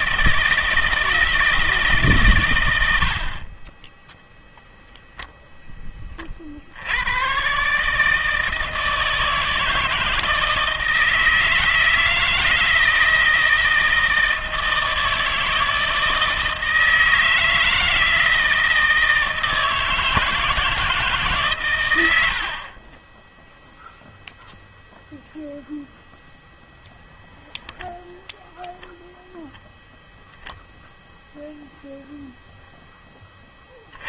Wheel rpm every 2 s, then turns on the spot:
160, 90, 0, 80, 160, 160, 160, 160, 160, 160, 160, 30, 0, 0, 0, 0, 0.
none